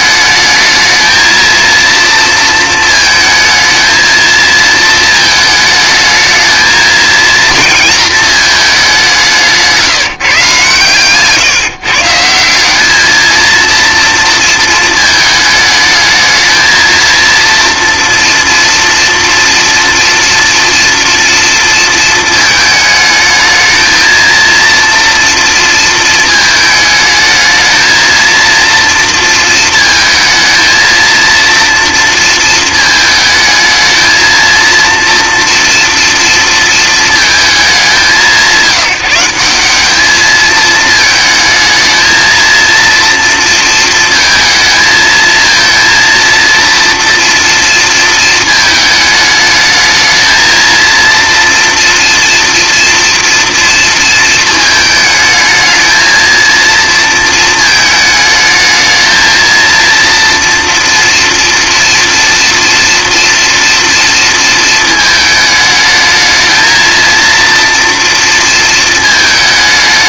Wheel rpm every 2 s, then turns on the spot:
220, 220, 220, 220, 200, 140, 190, 230, 230, 230, 230, 220, 230, 220, 230, 230, 220, 230, 230, 180, 220, 230, 220, 230, 220, 230, 230, 220, 230, 220, 240, 230, 220, 220, 220.
none